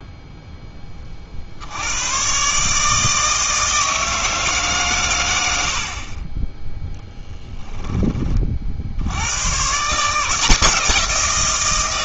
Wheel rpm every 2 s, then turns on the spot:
10, 140, 150, 10, 50, 170.
none